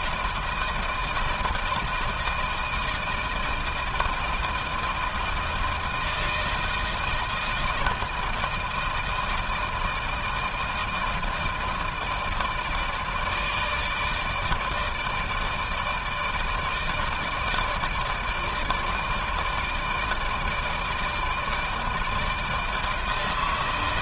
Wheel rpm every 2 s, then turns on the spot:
160, 160, 160, 160, 160, 160, 160, 150, 160, 160, 160, 160.
none